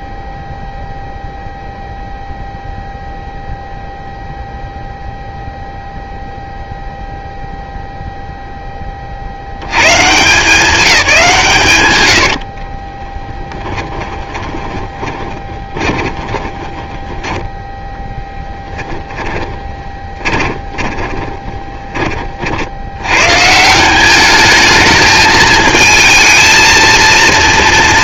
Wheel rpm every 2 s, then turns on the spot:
0, 0, 0, 0, 10, 170, 70, 20, 10, 20, 20, 50, 210, 220.
12-22